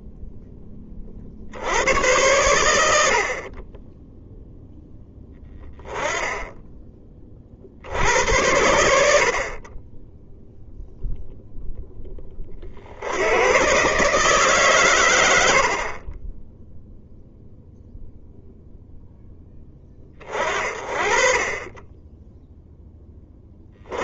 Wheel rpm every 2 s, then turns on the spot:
20, 100, 0, 10, 80, 0, 50, 130, 0, 0, 40, 10.
none